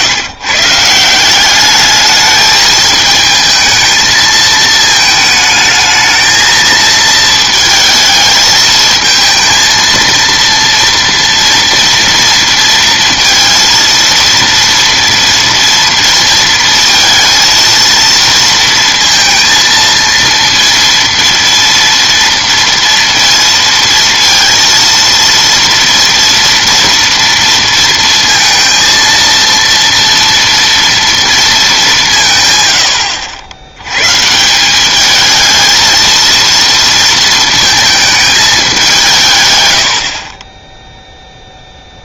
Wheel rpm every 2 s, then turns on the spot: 150, 220, 220, 220, 220, 230, 230, 230, 230, 230, 230, 230, 230, 230, 230, 230, 120, 180, 230, 210, 20.
none